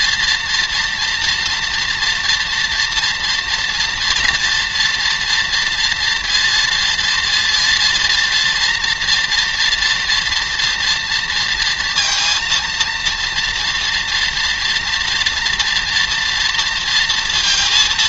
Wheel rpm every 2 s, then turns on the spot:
240, 230, 230, 230, 240, 230, 230, 230, 230.
none